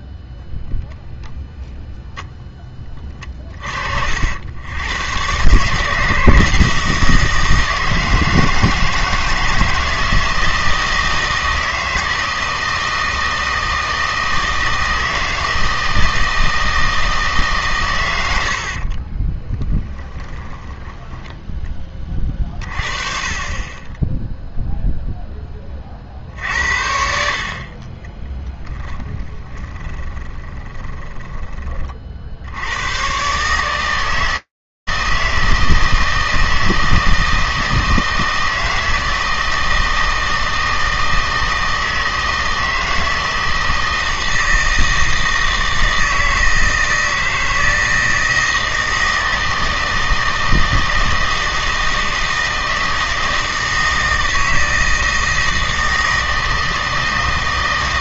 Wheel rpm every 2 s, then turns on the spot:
0, 20, 90, 160, 160, 160, 160, 160, 160, 60, 20, 40, 0, 60, 10, 20, 90, 160, 160, 160, 160, 160, 160, 160, 160, 160, 160, 160, 160.
18-20 28-32